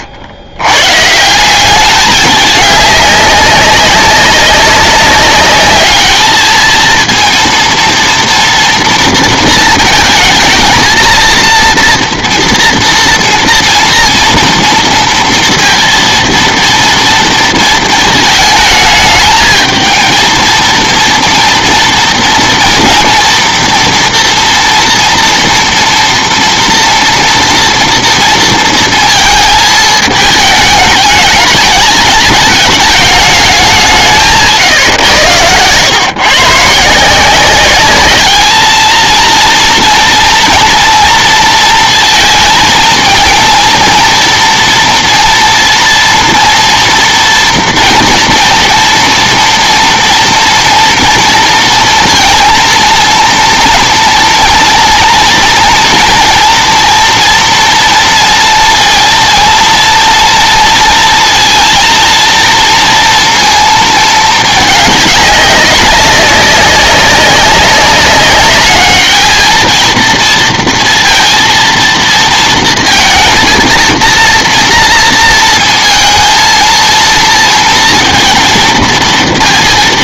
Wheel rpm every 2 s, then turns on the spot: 100, 200, 200, 220, 230, 220, 240, 230, 230, 220, 230, 230, 240, 230, 230, 210, 210, 150, 140, 220, 230, 230, 230, 230, 230, 230, 230, 230, 230, 230, 230, 230, 210, 200, 200, 230, 230, 240, 230, 230.
none